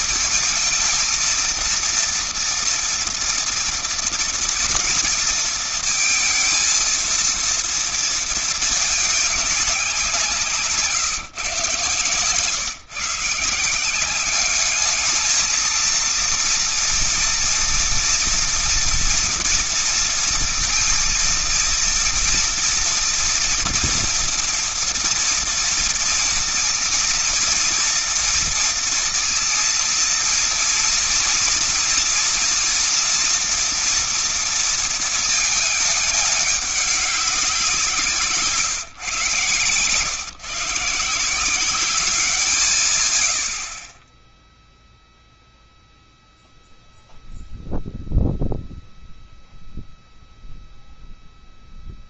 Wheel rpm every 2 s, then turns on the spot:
220, 230, 230, 230, 220, 170, 140, 200, 230, 230, 230, 230, 230, 230, 230, 230, 230, 230, 210, 160, 140, 170, 10, 0, 0, 0.
none